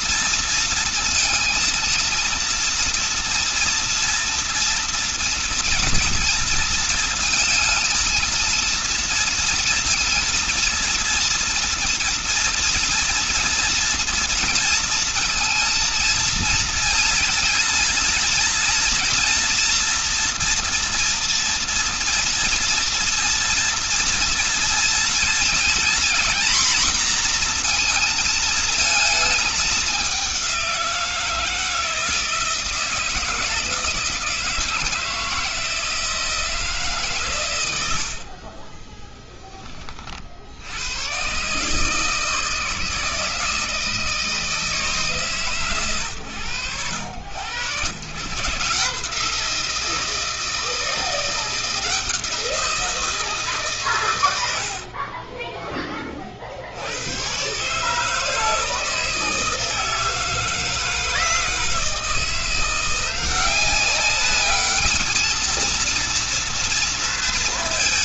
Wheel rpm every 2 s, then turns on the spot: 230, 230, 240, 230, 230, 230, 230, 230, 230, 230, 230, 230, 230, 230, 220, 180, 160, 160, 150, 30, 80, 160, 150, 90, 150, 160, 170, 60, 90, 160, 160, 170, 210, 230.
38-40 54-56